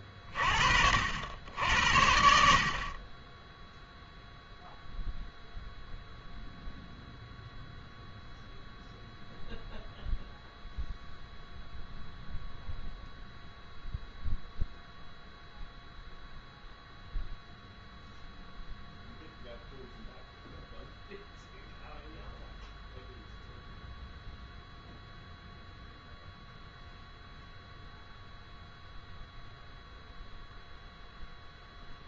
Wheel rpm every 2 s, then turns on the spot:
70, 0, 0, 0, 0, 0, 0, 0, 0, 0, 0, 0, 0, 0, 0, 0.
none